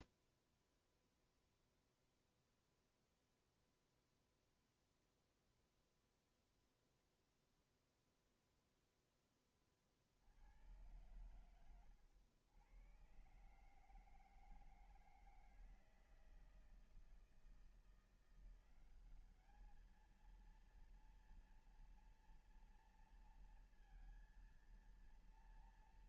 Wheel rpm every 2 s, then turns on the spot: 0, 0, 0, 0, 0, 60, 100, 150, 160, 170, 220, 230, 230.
none